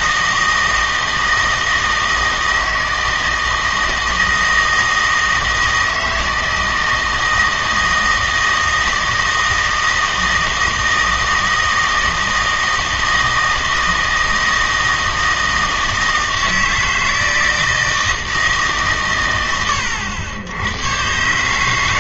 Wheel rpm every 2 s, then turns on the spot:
160, 160, 160, 160, 160, 160, 160, 160, 160, 150, 100.
none